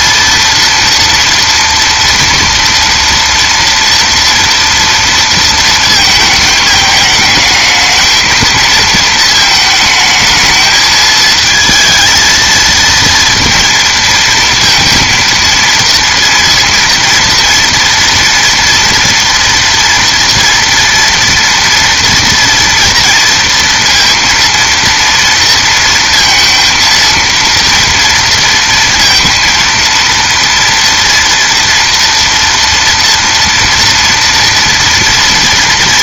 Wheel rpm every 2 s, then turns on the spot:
230, 230, 230, 220, 220, 220, 230, 230, 230, 230, 230, 230, 230, 230, 230, 230, 230, 230.
none